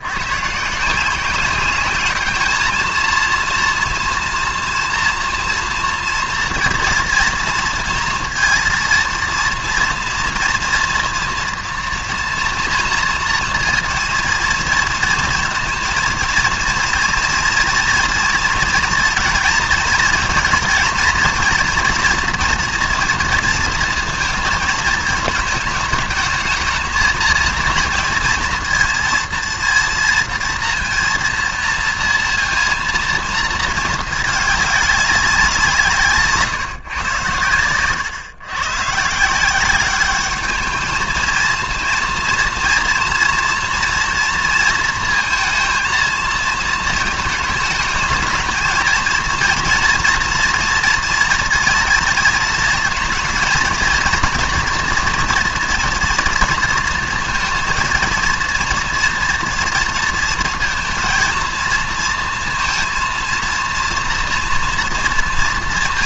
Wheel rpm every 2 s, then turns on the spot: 150, 210, 230, 230, 230, 230, 230, 230, 230, 230, 230, 230, 230, 220, 230, 230, 230, 210, 150, 130, 210, 230, 230, 220, 220, 230, 220, 230, 230, 230, 230, 230, 230.
none